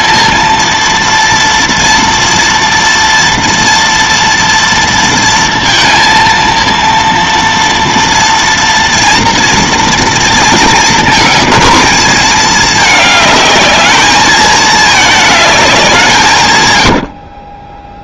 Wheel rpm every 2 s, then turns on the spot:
230, 230, 230, 230, 230, 220, 210, 210, 120.
none